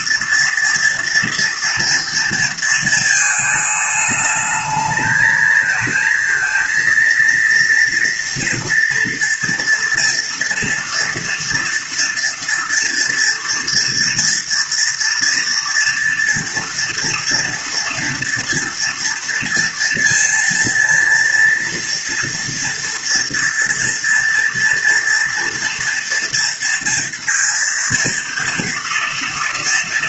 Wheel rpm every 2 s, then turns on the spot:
230, 220, 220, 230, 230, 230, 230, 230, 230, 230, 230, 230, 230, 230, 230.
none